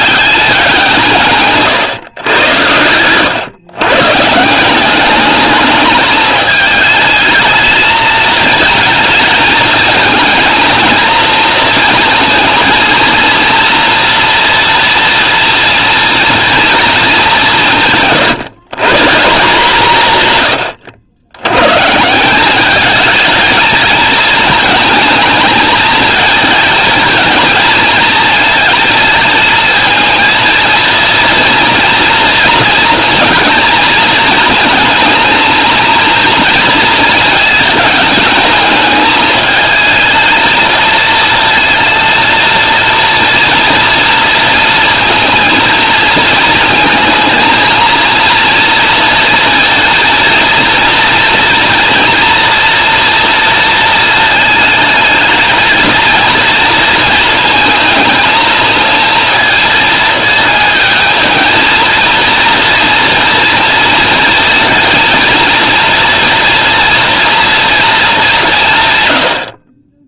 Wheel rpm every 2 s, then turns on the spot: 170, 100, 190, 220, 220, 220, 230, 230, 230, 160, 80, 210, 220, 220, 220, 230, 230, 220, 220, 220, 220, 230, 230, 230, 230, 230, 230, 220, 230, 230, 220, 230, 220, 230, 140.
2-4